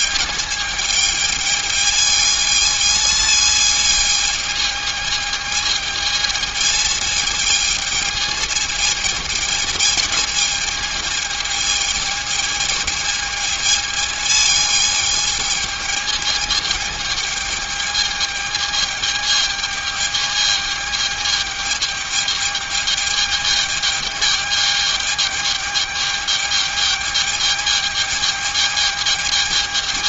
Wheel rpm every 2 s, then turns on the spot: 210, 220, 220, 220, 220, 220, 220, 220, 220, 220, 220, 210, 210, 210, 210.
none